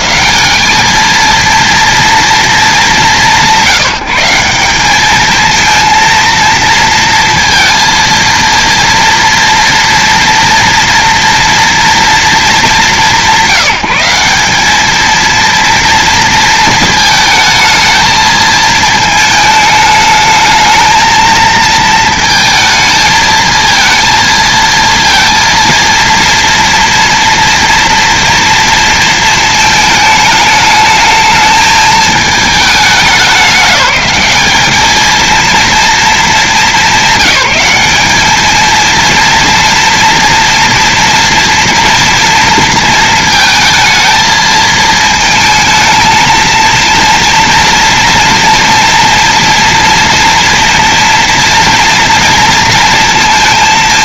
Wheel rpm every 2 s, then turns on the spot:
220, 200, 190, 230, 230, 230, 170, 210, 220, 220, 220, 220, 230, 230, 230, 210, 200, 210, 200, 230, 230, 230, 220, 230, 230, 240, 230.
none